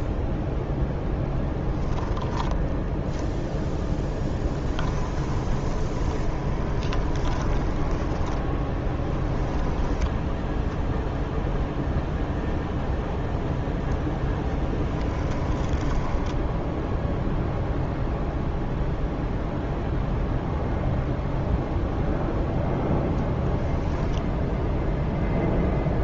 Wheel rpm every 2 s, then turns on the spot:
0, 0, 10, 20, 10, 10, 0, 10, 0, 0, 0, 10, 10.
4-8 10-12 14-16